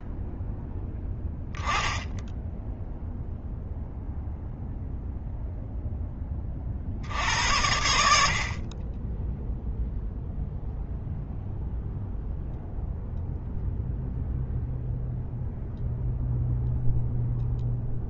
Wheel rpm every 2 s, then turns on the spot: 10, 0, 0, 40, 40, 0, 0, 0, 0.
none